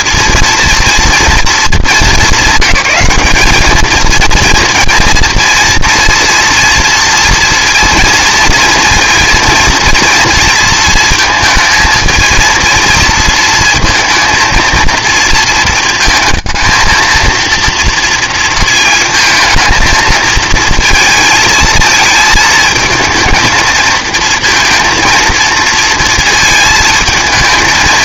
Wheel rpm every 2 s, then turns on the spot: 230, 200, 230, 230, 230, 230, 230, 230, 220, 230, 230, 220, 220, 230.
none